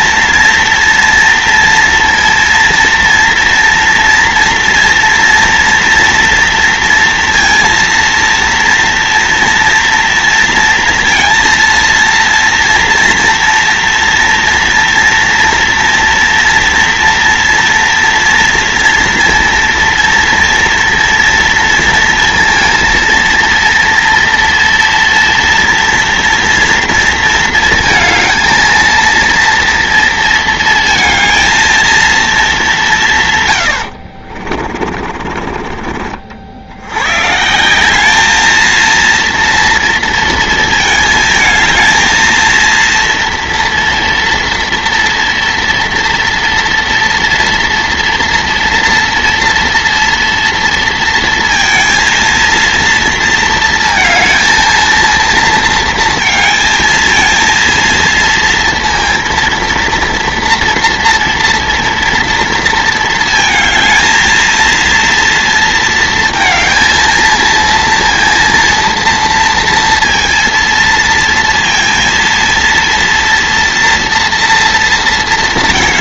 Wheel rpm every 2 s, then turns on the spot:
230, 230, 230, 230, 230, 230, 240, 230, 230, 230, 230, 230, 230, 230, 230, 230, 200, 50, 70, 220, 230, 220, 230, 230, 230, 230, 230, 230, 220, 230, 230, 230, 230, 230, 230, 230, 230, 230.
34-36